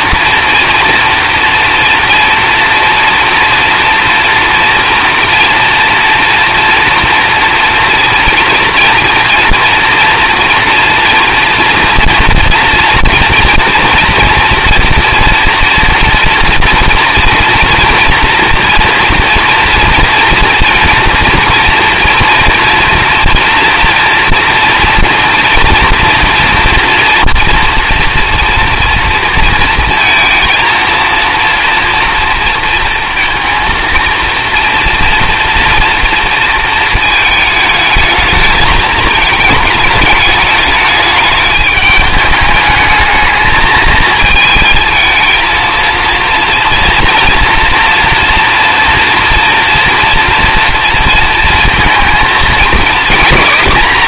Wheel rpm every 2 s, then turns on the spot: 240, 240, 230, 230, 230, 230, 240, 230, 230, 230, 230, 230, 230, 230, 230, 230, 230, 230, 230, 220, 210, 210, 220, 230, 240, 230, 220.
none